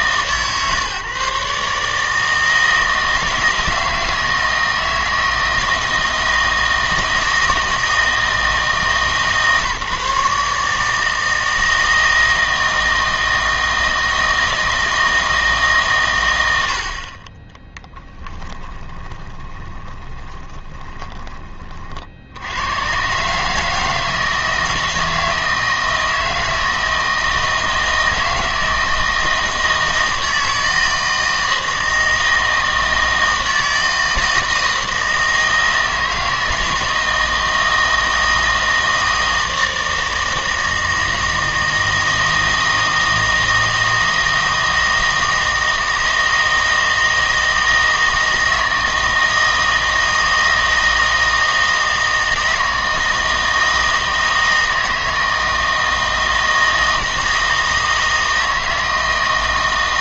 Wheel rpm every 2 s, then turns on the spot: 140, 160, 160, 160, 160, 150, 160, 160, 80, 10, 20, 100, 160, 160, 160, 160, 160, 160, 160, 160, 160, 160, 160, 160, 160, 160, 160, 160, 160, 160.
18-22